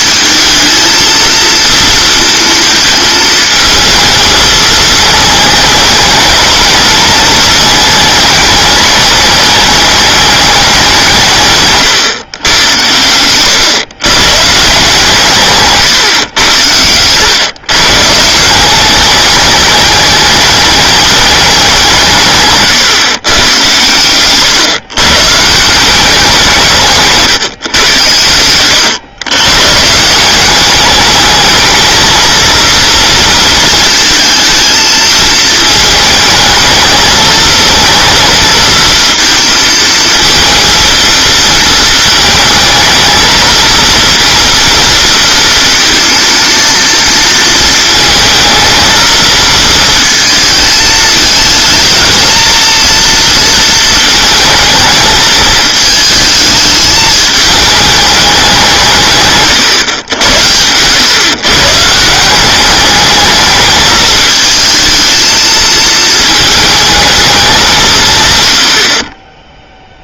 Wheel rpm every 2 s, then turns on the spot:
220, 220, 220, 220, 210, 200, 110, 150, 100, 180, 210, 130, 140, 160, 100, 200, 230, 220, 220, 230, 230, 220, 230, 230, 230, 220, 230, 220, 220, 170, 90, 200, 220, 220, 70.
none